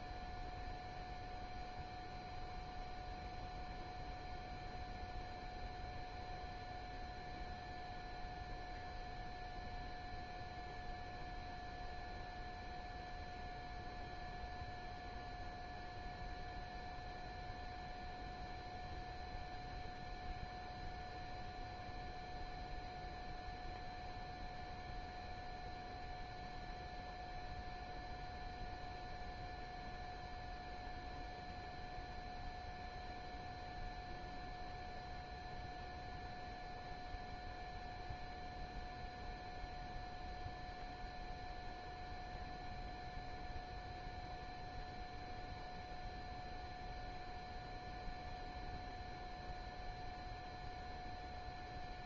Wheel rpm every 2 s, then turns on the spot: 0, 0, 0, 0, 0, 0, 0, 0, 0, 0, 0, 0, 0, 0, 0, 0, 0, 0, 0, 0, 0, 0, 0, 0, 0, 0.
none